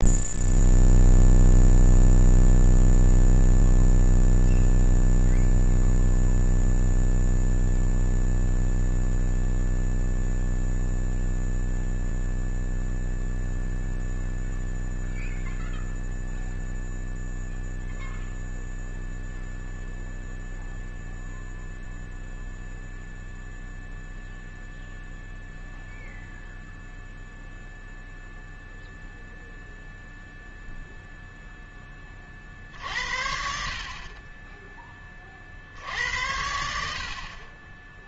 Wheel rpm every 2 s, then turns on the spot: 0, 0, 0, 0, 0, 0, 0, 0, 0, 0, 0, 0, 0, 0, 0, 0, 50, 20, 80.
none